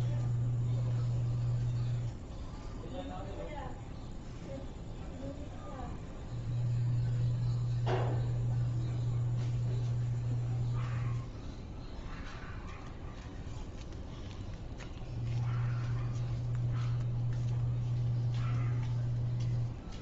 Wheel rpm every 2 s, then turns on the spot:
0, 0, 0, 0, 0, 0, 0, 0, 0, 0.
none